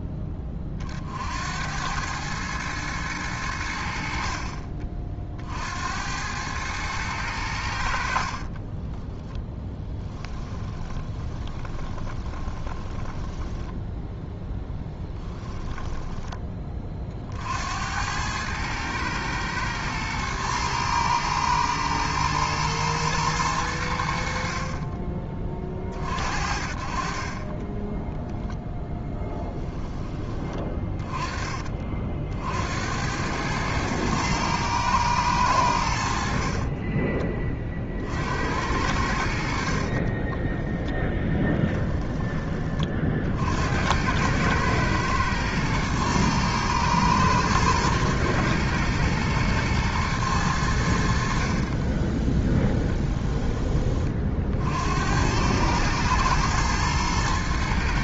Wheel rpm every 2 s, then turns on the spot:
30, 110, 40, 110, 20, 20, 10, 10, 30, 110, 110, 120, 30, 40, 10, 20, 80, 110, 30, 80, 10, 40, 110, 120, 110, 90, 10, 70, 110.
8-16 24-26 28-30 36-38 52-54